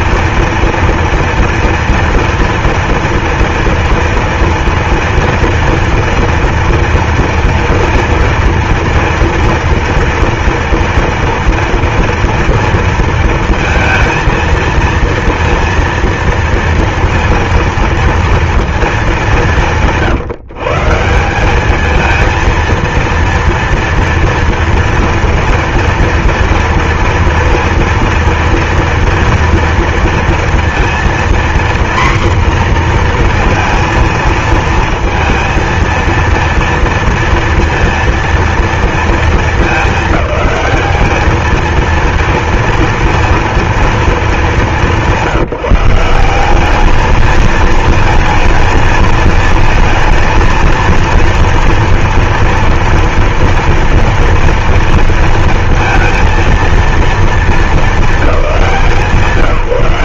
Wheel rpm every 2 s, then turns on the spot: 230, 230, 230, 230, 230, 230, 230, 230, 230, 210, 160, 230, 230, 230, 230, 240, 240, 230, 230, 230, 210, 230, 200, 210, 220, 230, 230, 230, 230, 180.
none